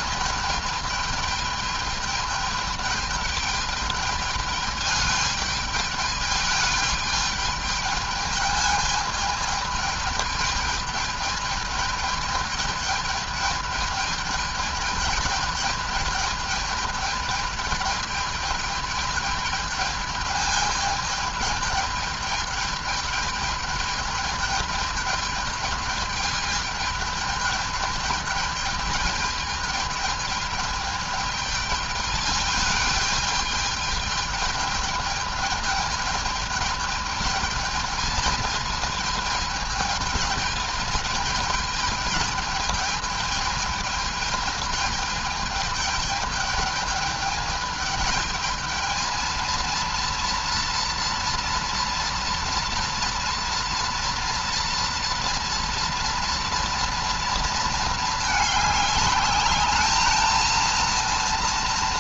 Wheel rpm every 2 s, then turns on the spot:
210, 210, 210, 210, 220, 210, 210, 210, 210, 210, 210, 210, 210, 210, 210, 210, 210, 210, 210, 220, 220, 210, 210, 210, 220, 230, 230, 230, 230, 210, 230.
none